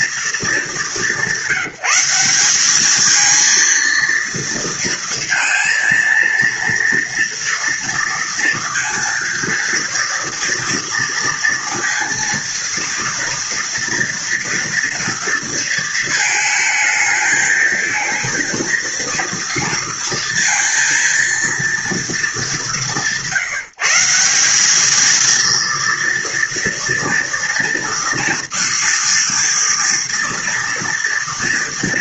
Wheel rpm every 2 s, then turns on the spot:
220, 200, 230, 230, 230, 230, 230, 230, 220, 230, 230, 200, 190, 230, 230, 230.
none